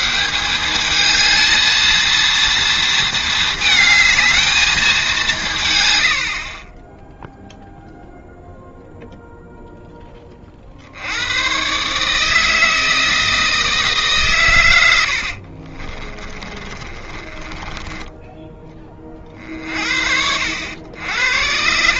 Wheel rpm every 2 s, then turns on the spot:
200, 230, 210, 20, 0, 60, 160, 100, 30, 40, 90.
16-18